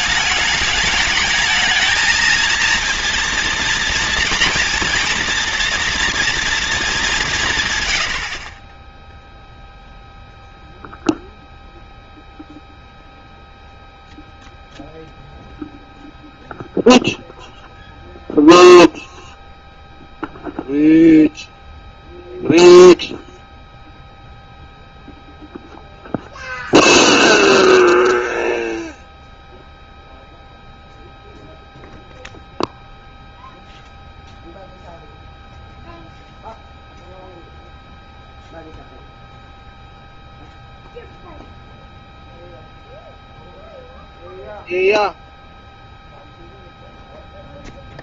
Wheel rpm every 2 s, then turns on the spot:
210, 230, 230, 220, 10, 0, 0, 0, 0, 0, 0, 0, 0, 0, 0, 0, 0, 0, 0, 0, 0, 0, 0, 0.
none